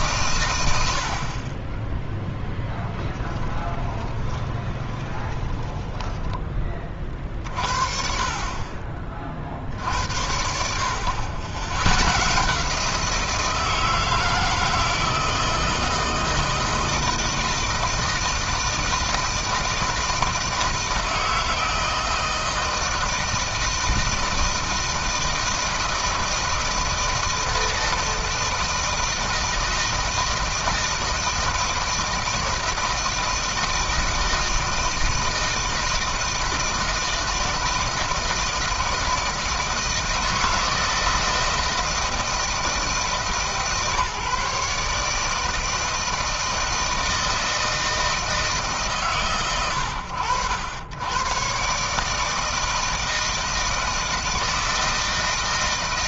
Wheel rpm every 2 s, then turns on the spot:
90, 0, 20, 30, 30, 70, 150, 160, 160, 160, 160, 160, 160, 160, 160, 160, 160, 160, 160, 160, 160, 160, 150, 160, 140, 100, 160, 160.
4-6